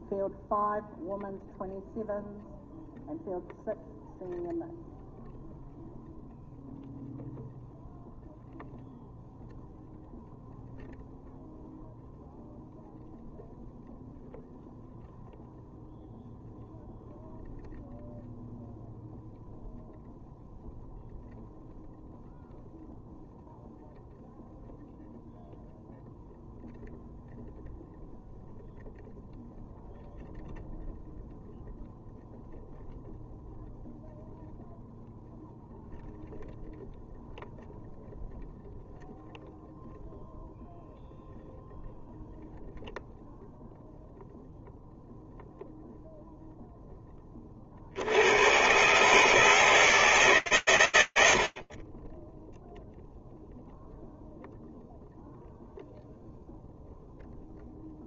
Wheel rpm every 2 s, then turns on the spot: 0, 0, 0, 0, 0, 0, 0, 0, 0, 0, 0, 0, 0, 0, 0, 0, 0, 0, 0, 0, 0, 0, 0, 10, 130, 110, 0, 0, 0.
none